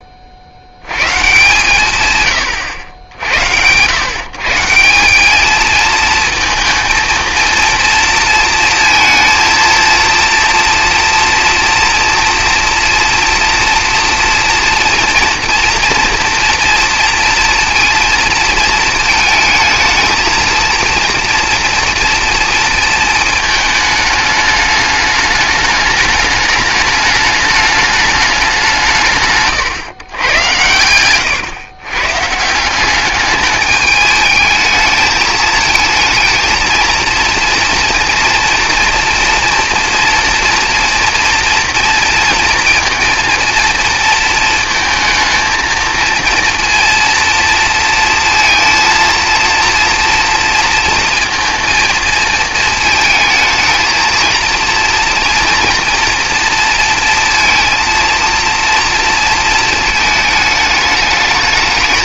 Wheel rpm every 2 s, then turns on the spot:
90, 90, 170, 230, 230, 240, 240, 230, 230, 220, 230, 230, 210, 210, 190, 110, 180, 220, 230, 240, 240, 230, 220, 230, 230, 230, 220, 230, 230, 230, 220.
none